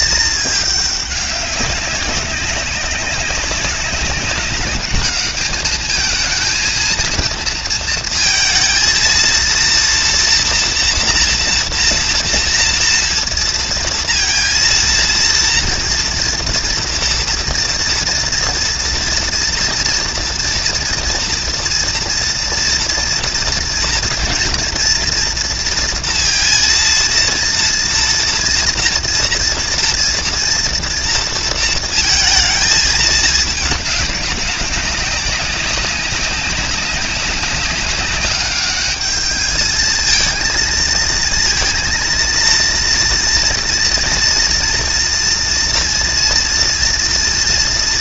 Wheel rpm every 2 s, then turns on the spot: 210, 200, 200, 220, 220, 230, 230, 230, 230, 230, 230, 240, 230, 230, 230, 230, 220, 200, 190, 200, 230, 230, 240, 230.
none